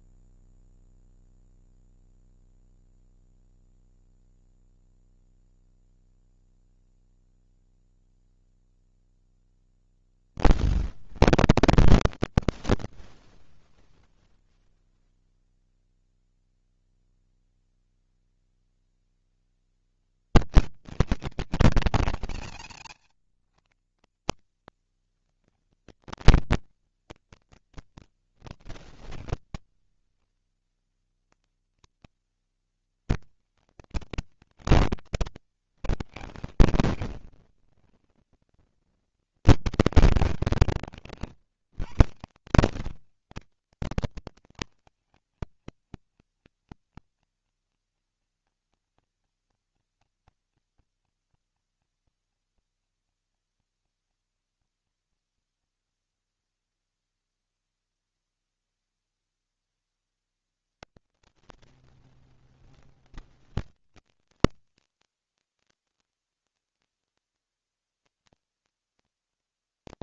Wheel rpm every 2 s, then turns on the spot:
20, 10, 0, 0, 0, 0, 0, 0, 10, 60, 170, 190, 130, 210, 100, 170, 200, 180, 140, 210, 180, 130, 220, 230, 230, 230, 230, 230, 230, 230, 190, 140, 220, 230, 180.
2-4